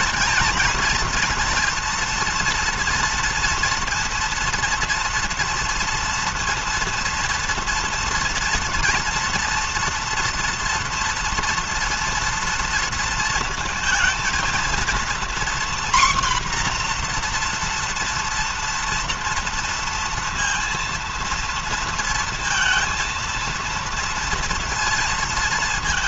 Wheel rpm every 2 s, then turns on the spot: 230, 230, 230, 230, 230, 240, 230, 230, 240, 230, 230, 230, 230.
none